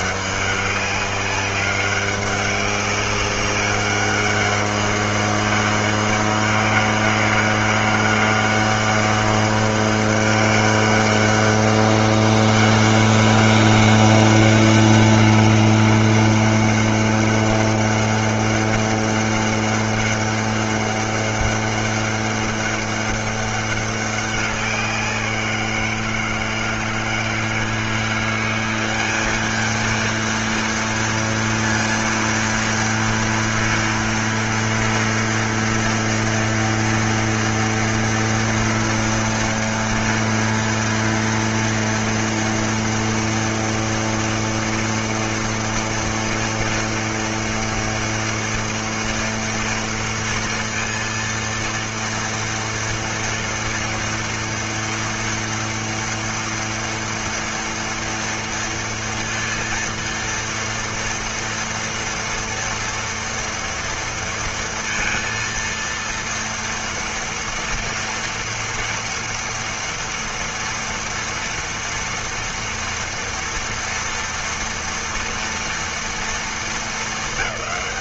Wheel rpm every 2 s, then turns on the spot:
200, 200, 200, 200, 200, 200, 200, 200, 200, 200, 200, 200, 190, 160, 180, 230, 230, 230, 230, 240, 230, 230, 230, 230, 230, 230, 230, 230, 230, 230, 230, 230, 230, 230, 230, 230, 230, 240, 220.
none